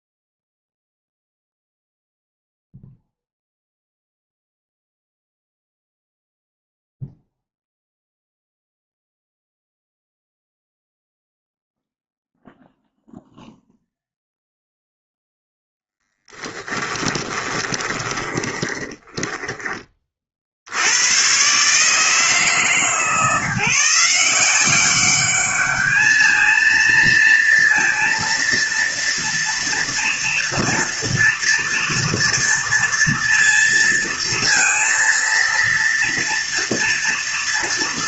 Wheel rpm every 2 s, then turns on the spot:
0, 0, 0, 0, 0, 0, 0, 0, 10, 10, 90, 150, 190, 230, 230, 230, 230, 230, 230.
16-20